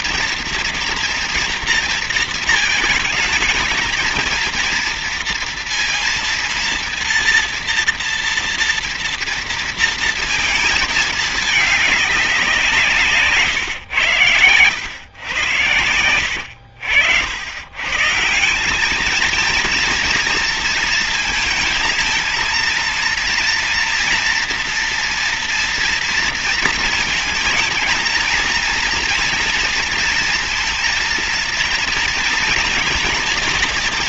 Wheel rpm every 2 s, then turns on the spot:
230, 230, 230, 230, 230, 230, 180, 110, 80, 170, 230, 230, 230, 230, 230, 230, 230.
16-18